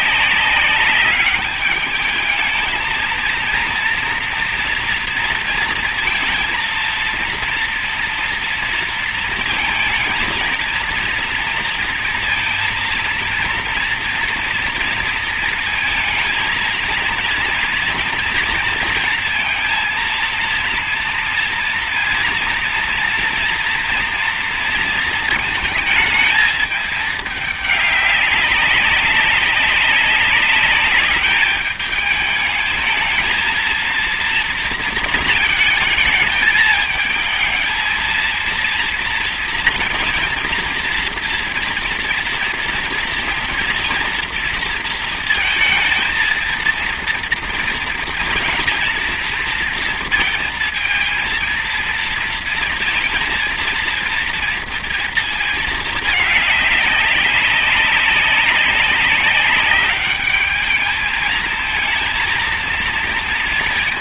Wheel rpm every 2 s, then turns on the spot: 200, 230, 230, 230, 230, 230, 230, 230, 230, 230, 230, 230, 230, 210, 190, 210, 220, 230, 220, 230, 230, 230, 230, 230, 230, 230, 230, 230, 200, 200, 210, 230.
none